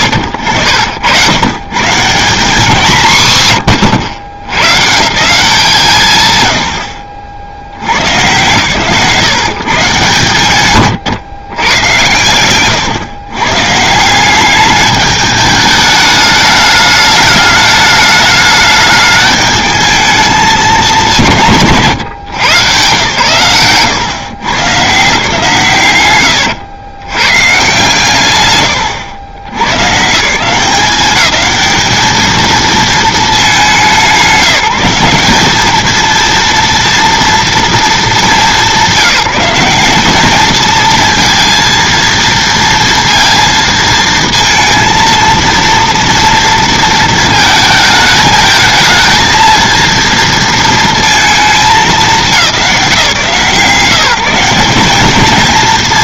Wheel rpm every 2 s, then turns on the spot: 70, 170, 110, 80, 120, 120, 120, 200, 210, 210, 210, 120, 130, 90, 110, 170, 220, 180, 230, 200, 220, 230, 230, 230, 220, 230, 180, 190.
12-14